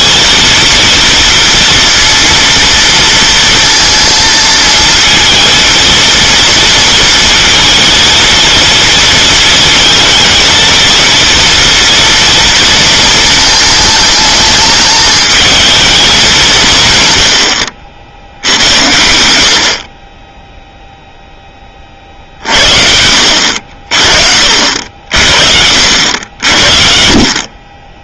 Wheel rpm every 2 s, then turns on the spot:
230, 230, 220, 230, 230, 230, 230, 220, 170, 80, 0, 50, 60, 70.
none